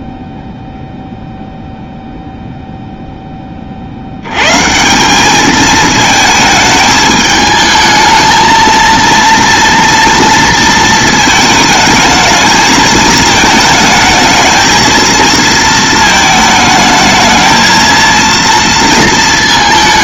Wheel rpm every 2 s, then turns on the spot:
0, 0, 140, 220, 220, 230, 220, 220, 220, 230.
none